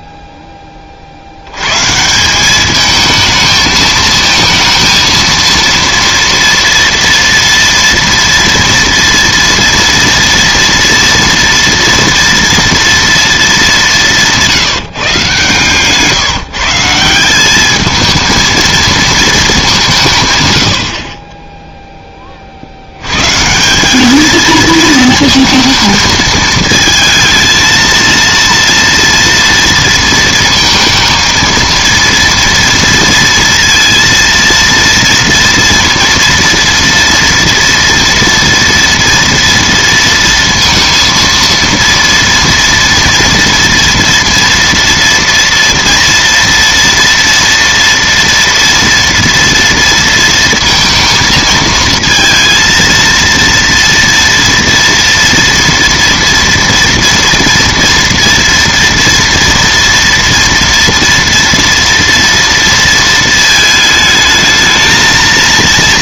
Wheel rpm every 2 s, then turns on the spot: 20, 210, 230, 230, 230, 230, 230, 170, 160, 230, 80, 60, 220, 220, 230, 230, 230, 230, 230, 230, 230, 230, 230, 230, 230, 230, 230, 230, 230, 230, 230, 230, 220.
none